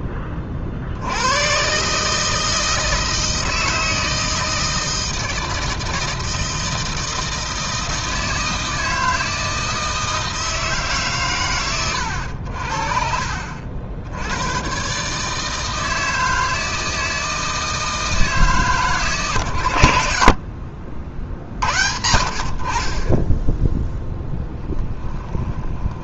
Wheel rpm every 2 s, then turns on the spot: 60, 160, 160, 160, 160, 140, 50, 130, 160, 130, 40, 40, 10.
24-26